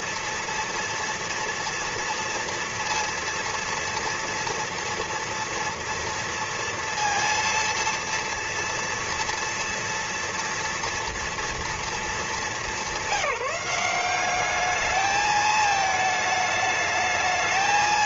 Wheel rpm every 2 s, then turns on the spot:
230, 230, 230, 230, 230, 230, 210, 210, 210.
none